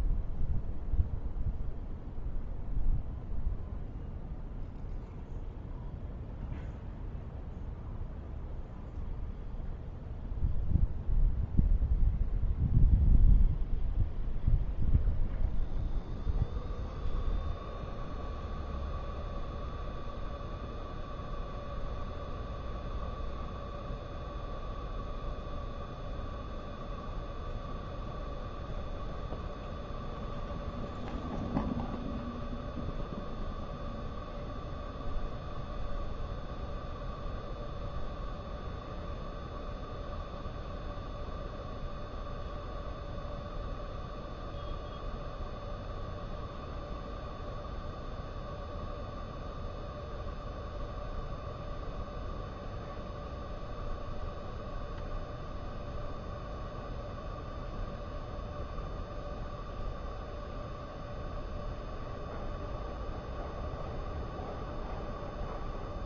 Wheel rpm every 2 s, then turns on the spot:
0, 0, 0, 0, 0, 0, 0, 0, 0, 0, 0, 0, 0, 0, 0, 0, 0, 0, 0, 0, 0, 0, 0, 0, 0, 0, 0, 0, 0, 0, 0, 0, 0.
none